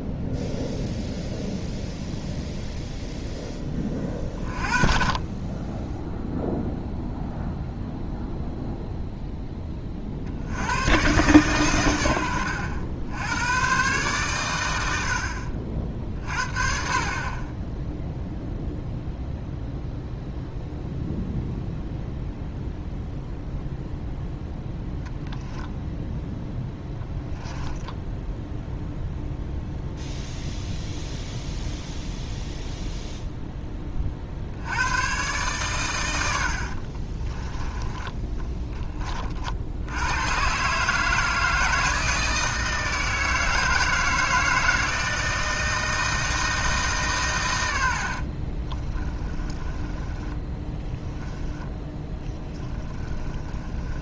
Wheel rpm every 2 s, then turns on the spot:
0, 0, 20, 0, 0, 70, 80, 110, 30, 0, 0, 0, 0, 0, 0, 0, 0, 70, 90, 10, 130, 160, 160, 160, 30, 10, 20.
36-40 48-54